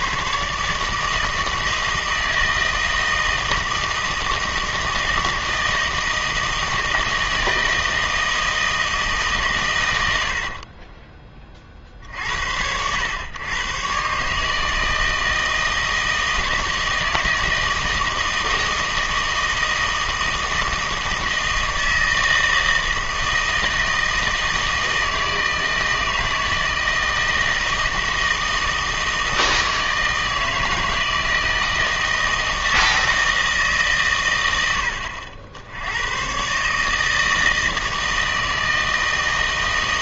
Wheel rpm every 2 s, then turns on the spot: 140, 160, 160, 160, 160, 50, 80, 160, 160, 160, 160, 160, 160, 160, 160, 160, 160, 90, 140, 160.
10-12